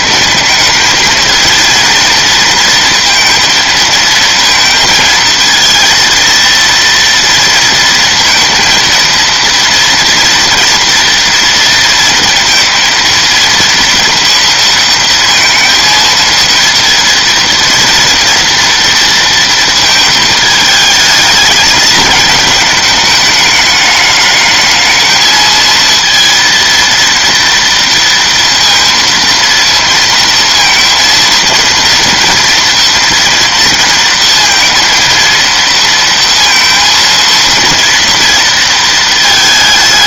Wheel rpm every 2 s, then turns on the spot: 220, 230, 230, 230, 230, 230, 230, 230, 230, 230, 210, 210, 210, 230, 230, 230, 230, 230, 230, 230.
none